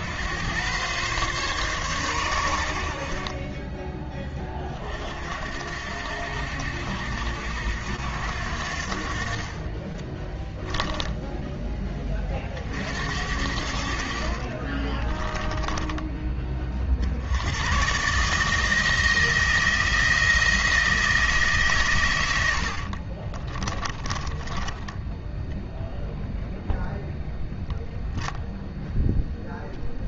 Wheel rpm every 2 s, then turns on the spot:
120, 70, 40, 70, 60, 10, 50, 30, 40, 160, 170, 50, 10, 0, 0.
14-16 22-24